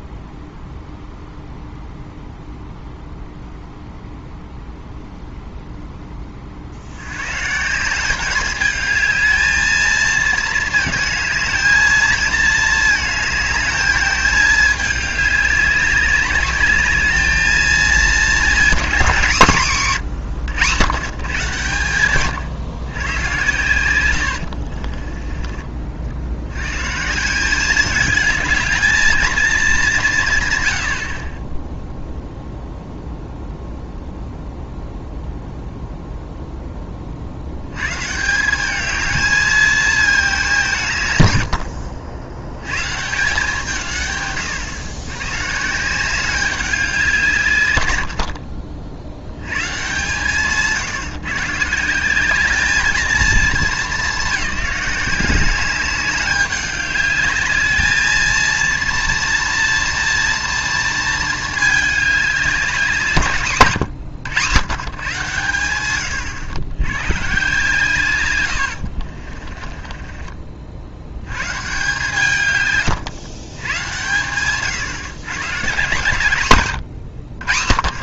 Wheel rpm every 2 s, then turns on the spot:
0, 0, 0, 60, 210, 220, 220, 210, 210, 220, 140, 120, 60, 110, 220, 100, 0, 0, 10, 200, 170, 110, 120, 190, 60, 160, 210, 210, 200, 230, 230, 190, 140, 110, 90, 50, 130, 140, 130.
24-26 68-70 74-76